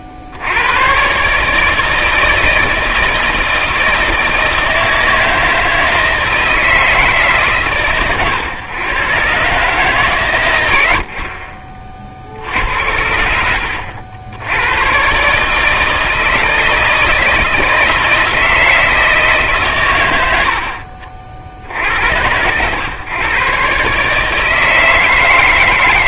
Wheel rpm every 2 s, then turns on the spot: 80, 160, 160, 160, 120, 100, 70, 100, 160, 160, 80, 110, 160.
none